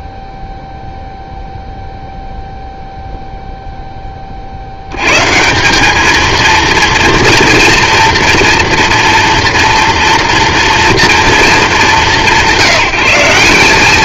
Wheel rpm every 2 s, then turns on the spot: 0, 0, 60, 230, 230, 230, 180.
none